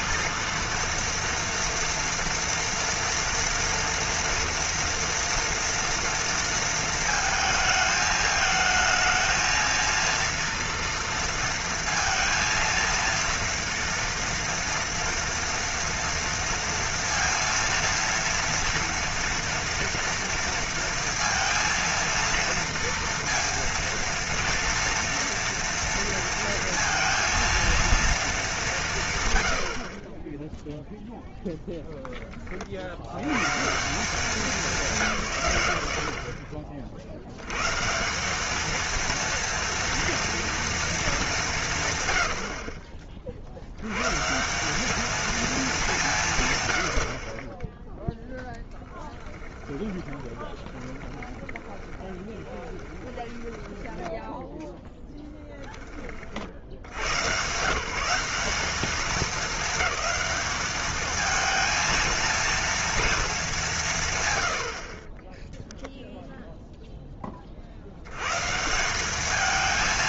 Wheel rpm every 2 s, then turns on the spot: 230, 230, 230, 230, 220, 230, 230, 230, 230, 230, 230, 230, 230, 230, 220, 0, 70, 170, 50, 220, 230, 40, 190, 110, 10, 20, 20, 10, 90, 200, 210, 230, 60, 0, 160.
48-54